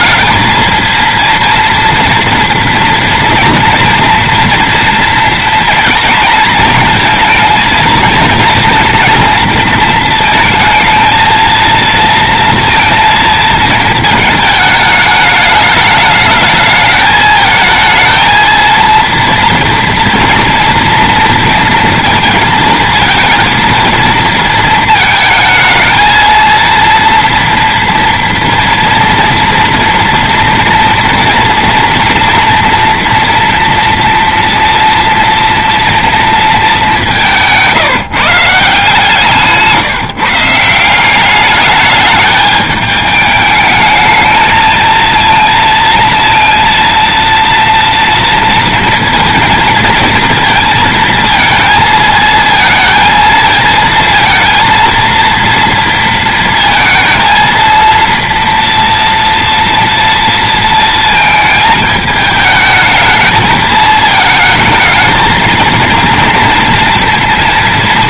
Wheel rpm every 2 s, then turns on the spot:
230, 230, 230, 220, 230, 230, 230, 210, 220, 230, 230, 220, 220, 230, 230, 230, 230, 230, 190, 160, 190, 210, 230, 230, 230, 230, 230, 230, 230, 240, 220, 220, 220, 230.
none